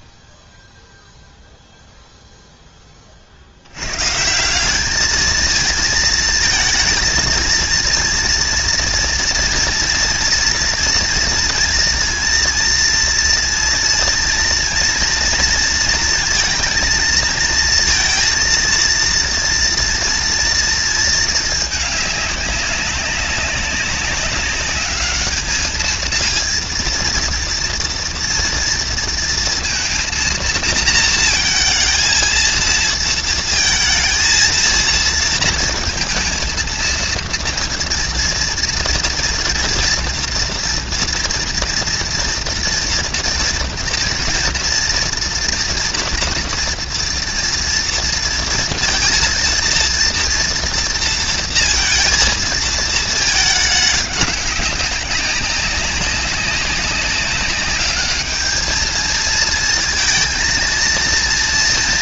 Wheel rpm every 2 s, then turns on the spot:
0, 140, 230, 230, 230, 230, 230, 230, 230, 230, 200, 200, 230, 230, 230, 230, 230, 230, 230, 230, 230, 240, 240, 230, 230, 230, 210, 190, 210, 230, 230.
none